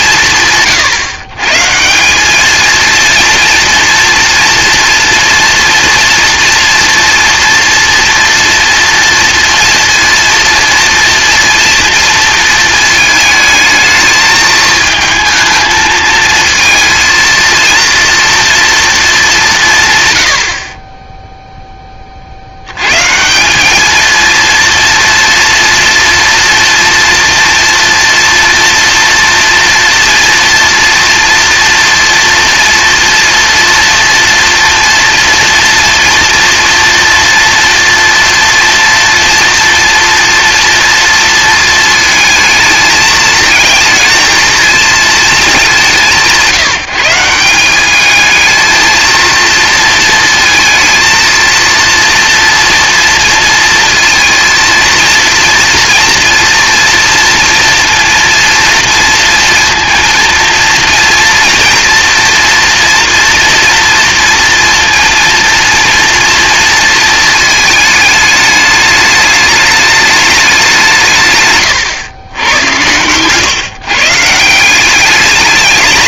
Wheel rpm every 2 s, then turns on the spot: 120, 230, 230, 230, 230, 230, 220, 220, 230, 230, 40, 110, 240, 230, 230, 230, 240, 230, 240, 230, 230, 220, 230, 170, 220, 230, 230, 230, 230, 230, 230, 230, 230, 230, 210, 170, 100, 180.
none